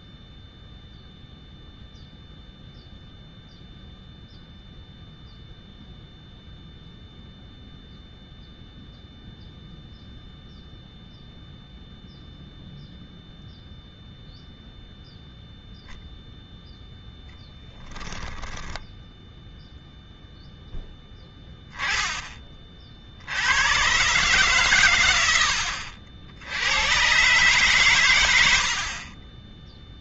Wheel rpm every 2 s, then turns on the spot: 0, 0, 0, 0, 0, 0, 0, 0, 0, 10, 0, 30, 130, 100, 90.
none